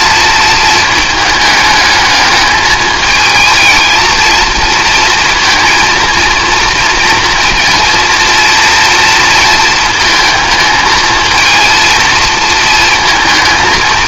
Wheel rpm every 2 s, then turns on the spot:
220, 220, 230, 230, 230, 220, 230.
none